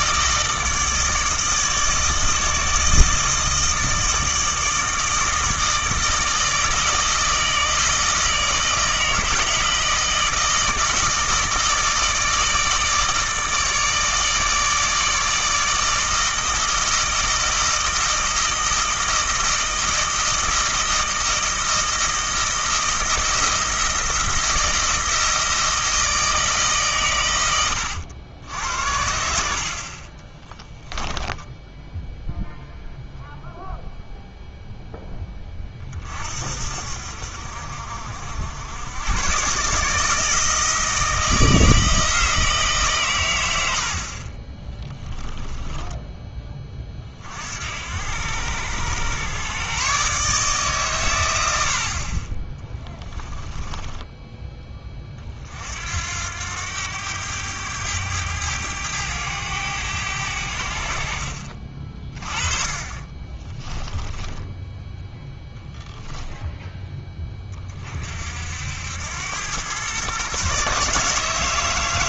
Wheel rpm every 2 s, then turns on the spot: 160, 160, 160, 160, 160, 160, 160, 160, 160, 160, 160, 160, 160, 150, 70, 10, 0, 0, 50, 80, 160, 160, 30, 20, 90, 140, 20, 10, 90, 100, 70, 30, 10, 10, 70, 140.
30-32 64-68